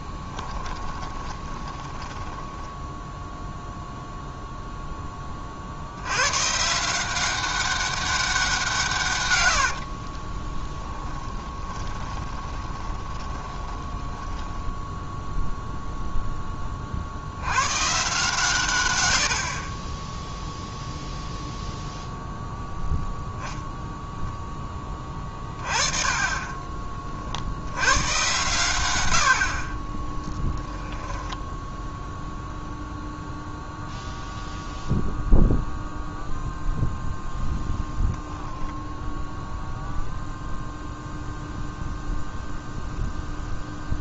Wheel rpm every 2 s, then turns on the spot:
30, 10, 0, 140, 170, 20, 20, 10, 10, 130, 0, 0, 10, 30, 110, 10, 0, 0, 0, 0, 0, 0.
0-4 10-16